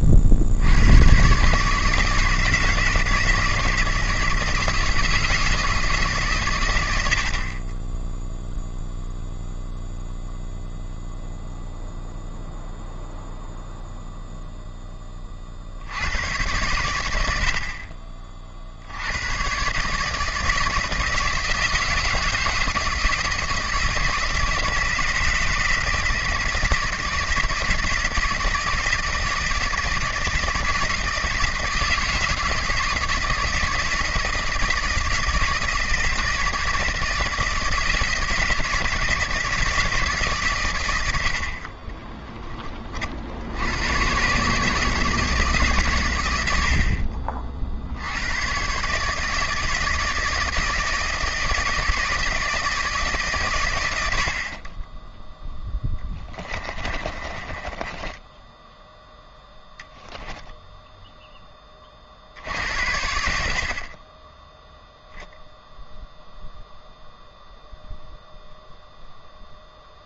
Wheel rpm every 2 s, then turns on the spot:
90, 160, 160, 90, 0, 0, 0, 20, 90, 100, 160, 160, 160, 160, 160, 160, 160, 160, 160, 160, 80, 70, 150, 60, 160, 160, 110, 10, 20, 0, 20, 60, 0, 0, 0.
54-58